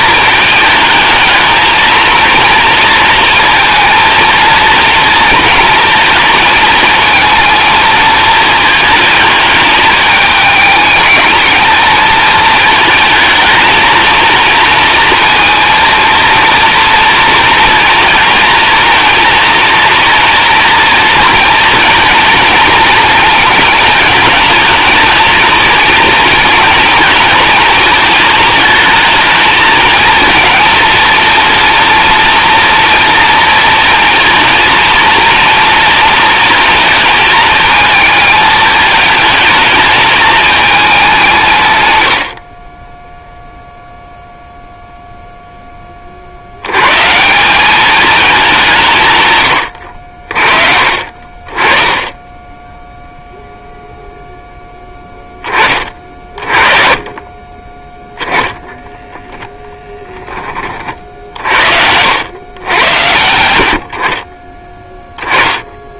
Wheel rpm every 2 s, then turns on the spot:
210, 230, 230, 220, 220, 220, 220, 230, 230, 230, 230, 230, 220, 230, 220, 220, 230, 230, 220, 220, 210, 20, 0, 100, 160, 40, 0, 10, 30, 10, 40, 110, 10.
58-60